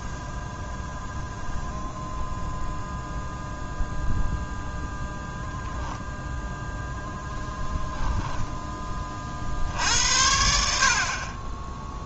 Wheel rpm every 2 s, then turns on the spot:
0, 0, 0, 0, 20, 50.
none